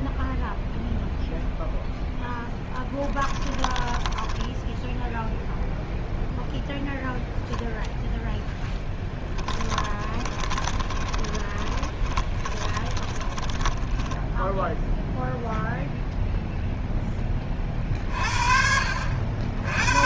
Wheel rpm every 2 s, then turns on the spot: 0, 10, 0, 0, 0, 20, 20, 0, 0, 50.
10-14